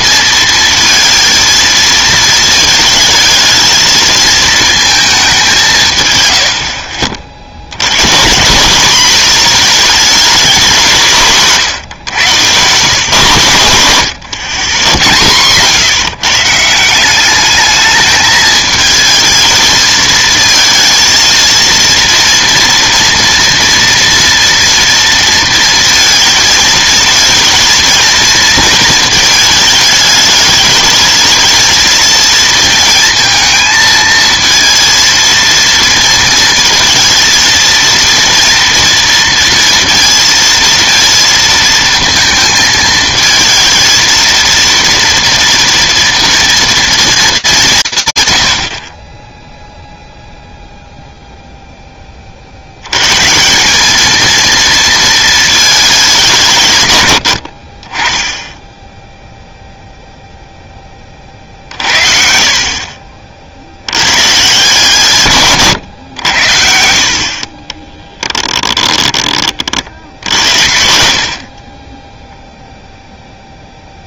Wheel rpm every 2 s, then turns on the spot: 230, 220, 220, 80, 180, 200, 100, 110, 150, 220, 220, 230, 230, 230, 230, 210, 230, 220, 230, 240, 230, 220, 230, 230, 80, 0, 70, 230, 120, 10, 0, 50, 140, 70, 10, 50, 0.
6-8 14-16 68-72